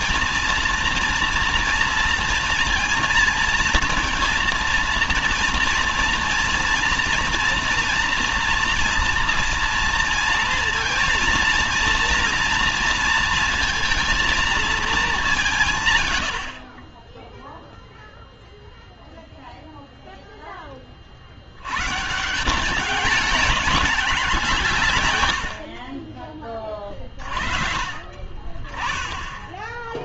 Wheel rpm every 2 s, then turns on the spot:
230, 230, 230, 230, 230, 230, 230, 210, 40, 0, 20, 200, 140, 30, 30.
26-28